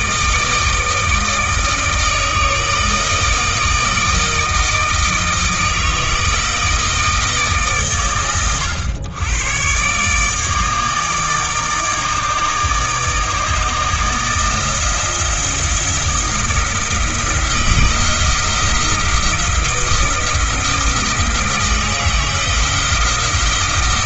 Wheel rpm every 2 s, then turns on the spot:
160, 160, 160, 160, 110, 150, 150, 160, 170, 170, 160, 170.
none